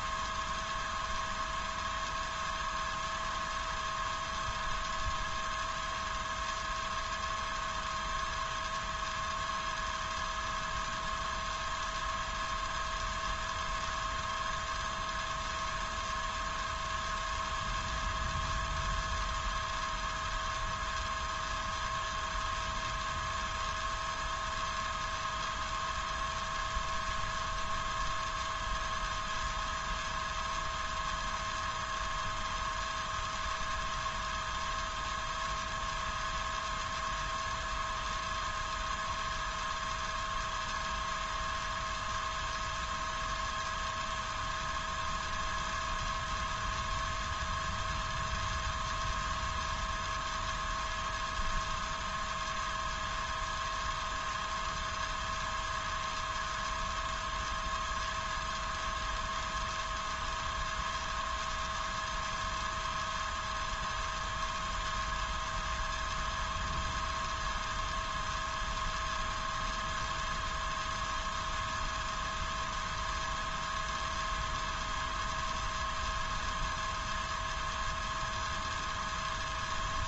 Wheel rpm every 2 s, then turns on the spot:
0, 0, 0, 0, 0, 0, 0, 0, 0, 0, 0, 0, 0, 0, 0, 0, 0, 0, 0, 0, 0, 0, 0, 0, 0, 0, 0, 0, 0, 0, 0, 0, 0, 0, 0, 0, 0, 0, 0, 0.
none